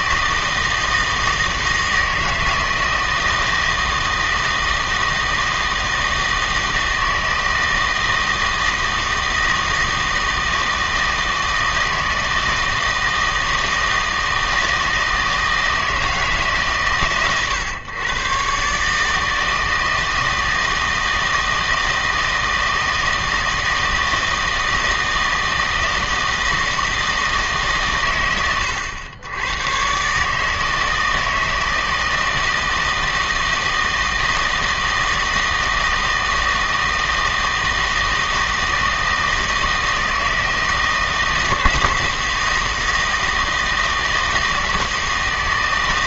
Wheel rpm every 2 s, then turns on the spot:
160, 160, 160, 160, 160, 160, 160, 160, 140, 130, 160, 160, 160, 160, 100, 160, 160, 160, 160, 160, 160, 160, 160.
none